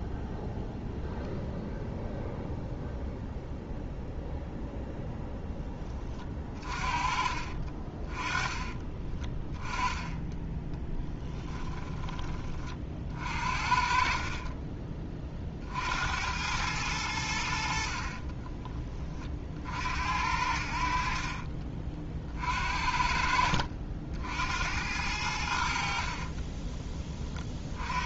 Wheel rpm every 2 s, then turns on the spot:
0, 0, 0, 40, 20, 10, 50, 30, 90, 30, 60, 50, 80, 20.
8-12